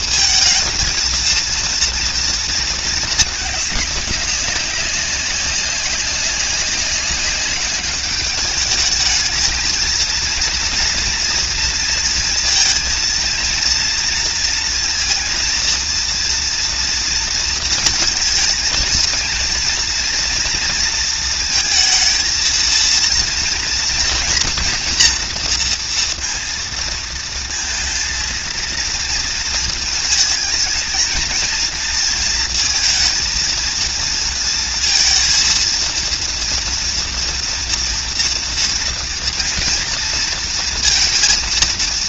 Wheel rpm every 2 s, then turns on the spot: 230, 220, 200, 190, 210, 230, 230, 230, 230, 220, 230, 230, 240, 230, 230, 220, 230, 230, 230, 230, 230.
none